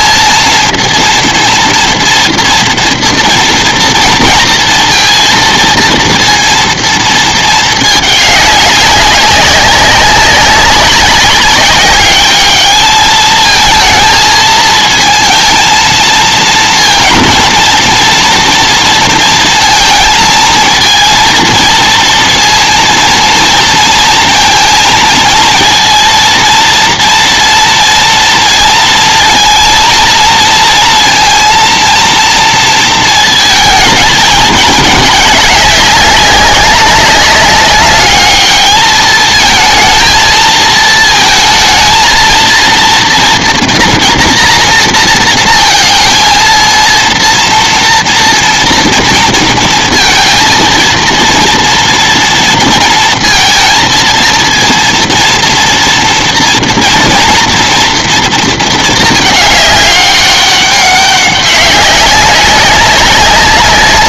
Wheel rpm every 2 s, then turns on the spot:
230, 230, 230, 230, 200, 200, 220, 230, 230, 230, 230, 230, 230, 230, 230, 230, 230, 210, 200, 220, 230, 230, 230, 230, 230, 230, 230, 230, 230, 210, 190, 200.
none